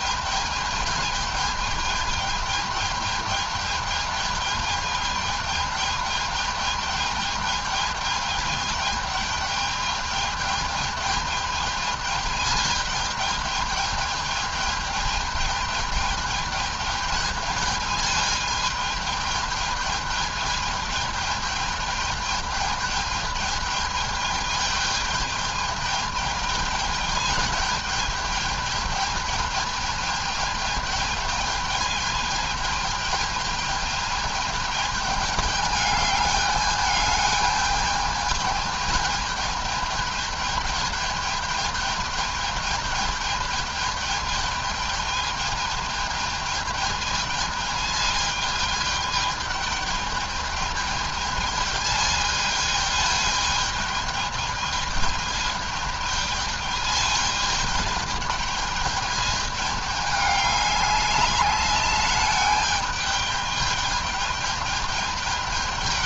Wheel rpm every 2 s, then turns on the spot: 210, 210, 210, 210, 210, 210, 220, 210, 210, 220, 210, 210, 210, 210, 210, 220, 210, 210, 210, 220, 210, 220, 210, 220, 210, 210, 220, 210, 220, 210, 200, 210, 210.
none